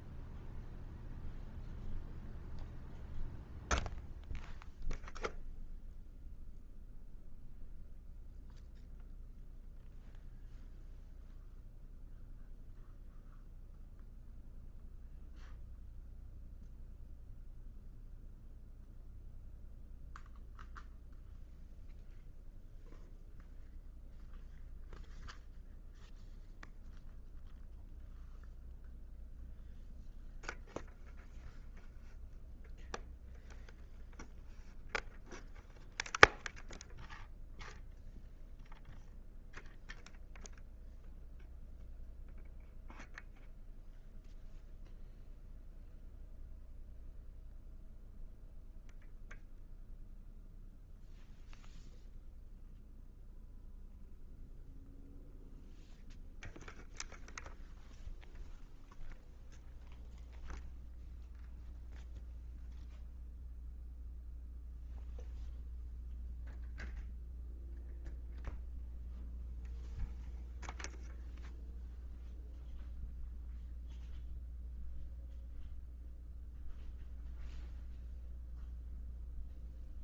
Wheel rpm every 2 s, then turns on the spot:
0, 0, 0, 0, 0, 0, 0, 0, 0, 0, 0, 0, 0, 0, 0, 0, 0, 0, 0, 0, 0, 0, 0, 0, 0, 0, 0, 0, 0, 0, 0, 0, 0, 0, 0, 0, 0, 0, 0, 0.
none